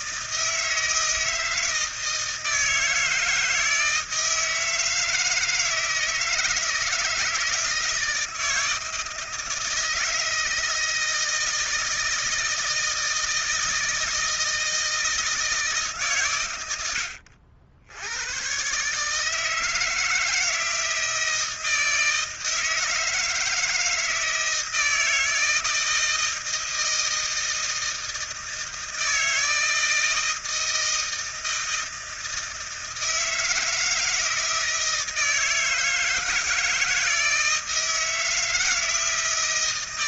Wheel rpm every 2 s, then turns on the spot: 160, 160, 160, 160, 160, 160, 160, 160, 100, 140, 160, 160, 160, 160, 160, 160, 160, 160, 160, 160.
none